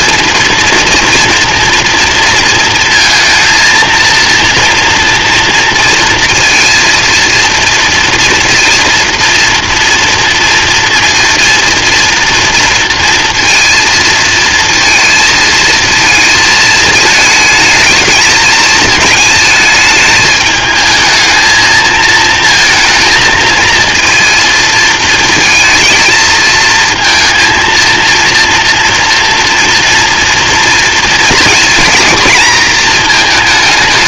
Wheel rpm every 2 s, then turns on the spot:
230, 230, 240, 230, 230, 240, 230, 230, 220, 210, 220, 220, 230, 230, 230, 230, 230.
none